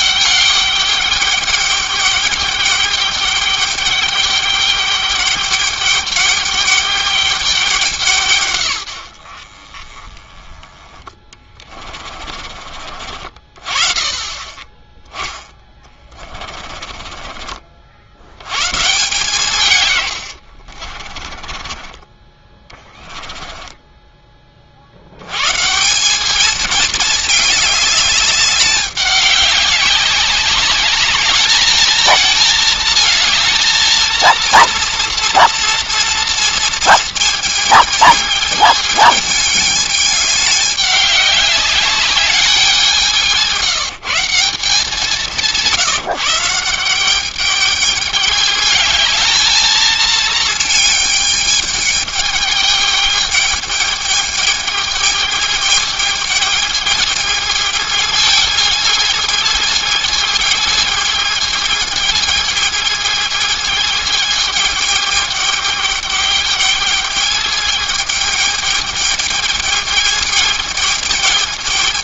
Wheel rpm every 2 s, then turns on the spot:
200, 200, 200, 210, 110, 20, 40, 10, 30, 120, 60, 20, 60, 220, 200, 200, 230, 230, 230, 210, 200, 190, 190, 190, 220, 220, 210, 210, 220, 220, 220, 220, 210, 210, 220, 220.
10-12 16-18 20-24